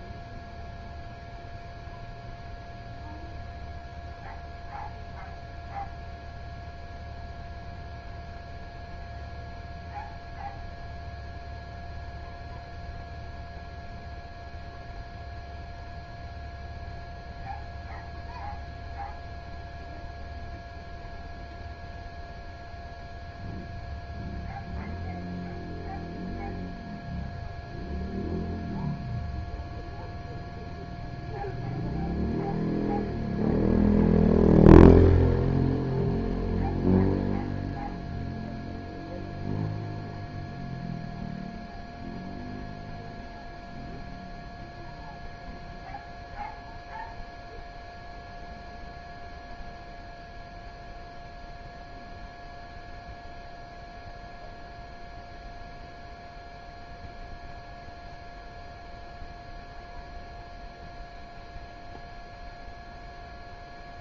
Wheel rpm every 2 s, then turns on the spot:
0, 0, 0, 0, 0, 0, 0, 0, 0, 0, 0, 0, 0, 0, 0, 0, 0, 0, 0, 0, 0, 0, 0, 0, 0, 0, 0, 0, 0, 0, 0, 0.
none